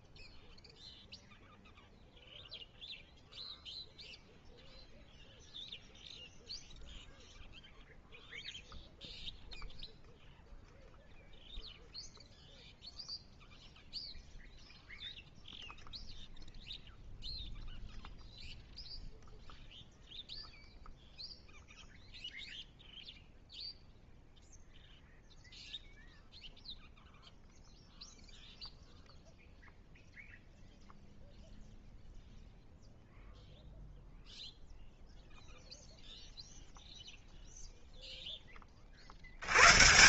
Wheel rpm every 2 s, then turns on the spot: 0, 0, 0, 0, 0, 0, 0, 0, 0, 0, 0, 0, 0, 0, 0, 0, 0, 0, 0, 90.
none